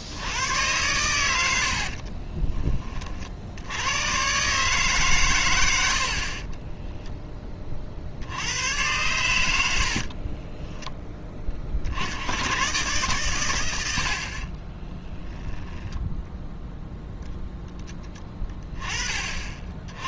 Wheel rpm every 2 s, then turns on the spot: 100, 30, 140, 10, 100, 10, 110, 10, 0, 20.
6-8 14-16